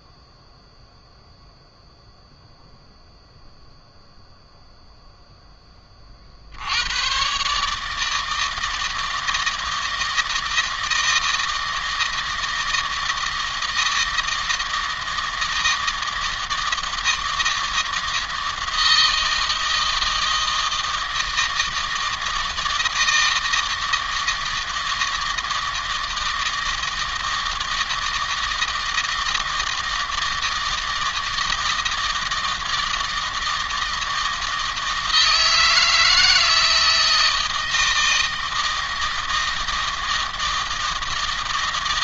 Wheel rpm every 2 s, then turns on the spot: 0, 0, 0, 80, 160, 160, 160, 160, 160, 160, 160, 160, 160, 160, 160, 160, 160, 160, 160, 160, 160.
none